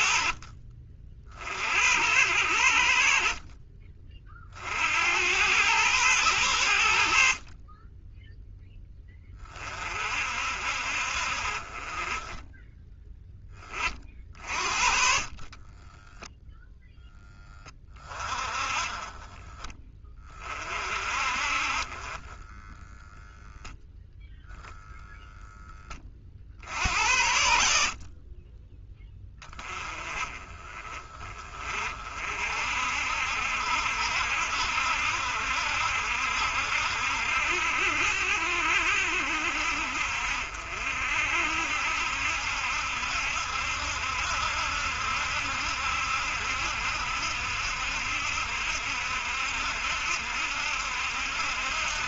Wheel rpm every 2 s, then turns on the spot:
40, 40, 70, 60, 10, 60, 10, 50, 0, 20, 50, 10, 0, 60, 20, 30, 50, 70, 70, 70, 60, 70, 70, 70, 70, 70.
none